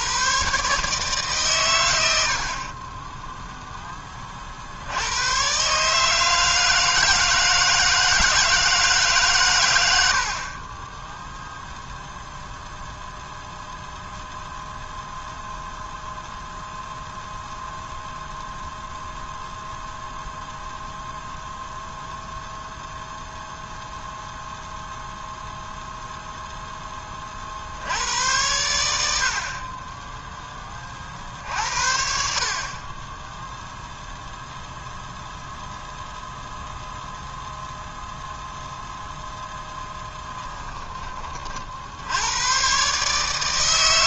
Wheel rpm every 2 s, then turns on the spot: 140, 30, 80, 160, 150, 20, 0, 0, 0, 0, 0, 0, 0, 10, 100, 30, 30, 0, 0, 0, 20, 140.
none